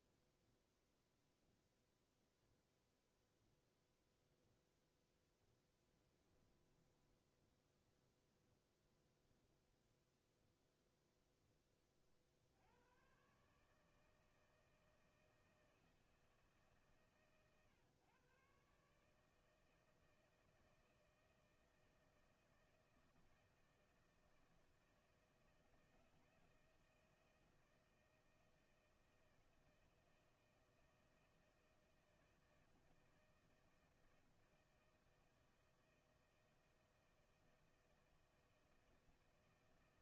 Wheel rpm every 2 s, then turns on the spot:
0, 0, 0, 10, 0, 0, 70, 160, 160, 130, 160, 160, 160, 160, 160, 160, 160, 160, 160, 160.
6-8